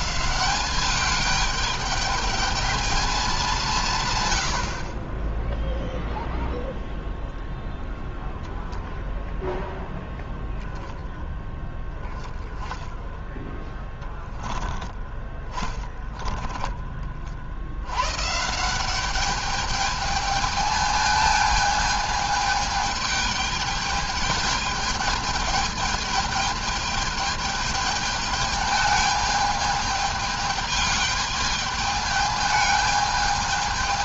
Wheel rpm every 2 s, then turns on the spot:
200, 220, 80, 0, 0, 0, 10, 10, 20, 160, 220, 210, 210, 220, 210, 210, 210.
none